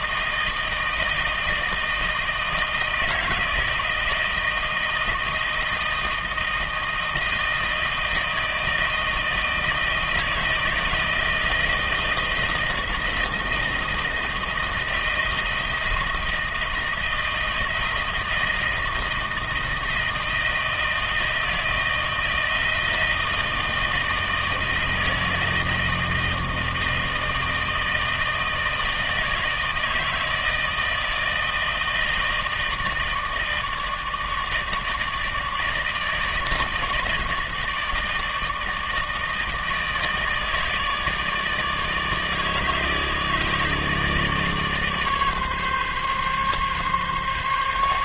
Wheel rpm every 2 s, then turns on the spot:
160, 160, 160, 160, 160, 160, 160, 160, 160, 160, 160, 160, 160, 160, 160, 160, 160, 160, 150, 160, 160, 150, 150, 140.
none